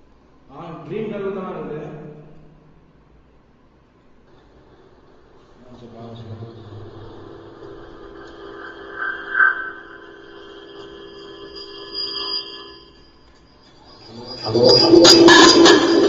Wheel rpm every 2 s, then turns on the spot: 0, 0, 0, 0, 0, 0, 0, 0.
none